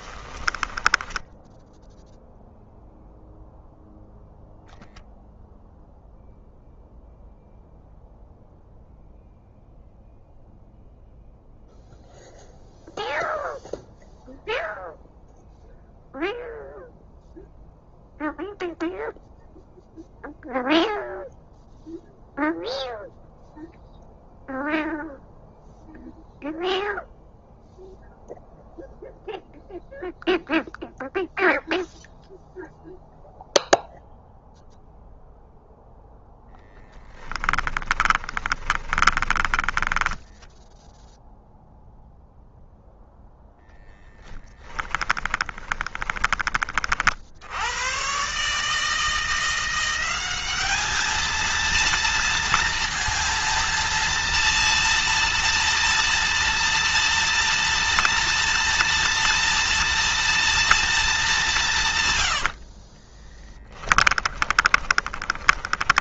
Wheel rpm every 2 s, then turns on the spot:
10, 0, 0, 0, 0, 0, 0, 0, 0, 0, 0, 0, 0, 0, 0, 0, 0, 0, 10, 20, 0, 0, 30, 40, 160, 210, 230, 230, 230, 230, 220, 50, 20.
0-2 36-40 44-46 64-66